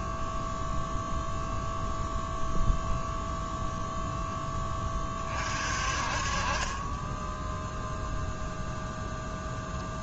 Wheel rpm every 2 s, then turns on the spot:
0, 0, 20, 20, 0.
none